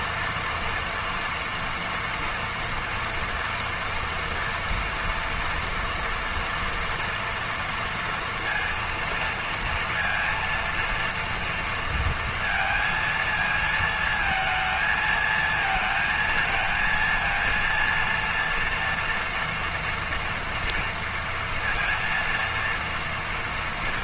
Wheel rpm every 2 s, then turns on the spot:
230, 230, 230, 230, 230, 230, 230, 220, 230, 230, 230, 230.
none